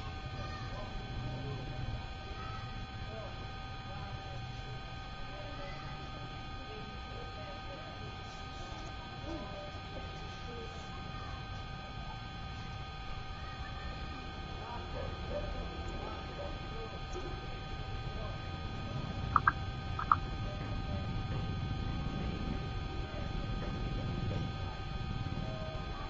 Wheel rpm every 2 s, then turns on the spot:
0, 0, 0, 0, 0, 0, 0, 0, 0, 0, 0, 0, 0.
none